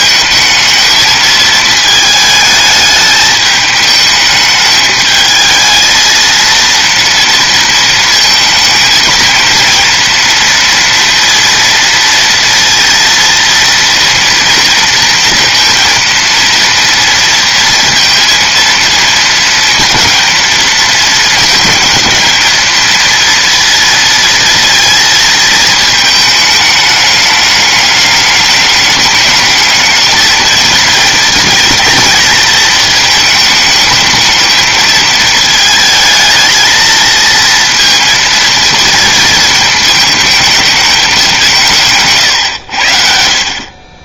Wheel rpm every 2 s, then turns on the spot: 220, 210, 210, 230, 220, 230, 230, 230, 230, 230, 230, 230, 230, 220, 220, 220, 220, 220, 220, 230, 210, 80.
none